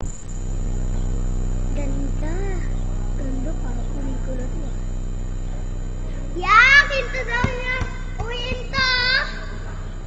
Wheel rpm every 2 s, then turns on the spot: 0, 0, 0, 0, 0.
none